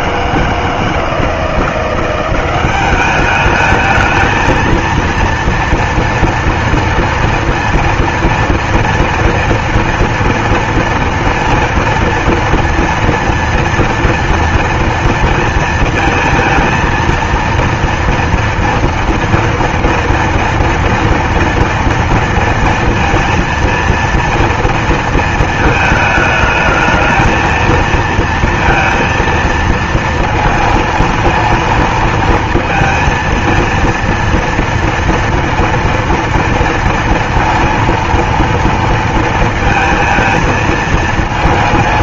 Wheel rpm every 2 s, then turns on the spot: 160, 190, 220, 230, 230, 230, 230, 230, 230, 230, 230, 230, 230, 220, 230, 230, 230, 230, 230, 230, 230.
none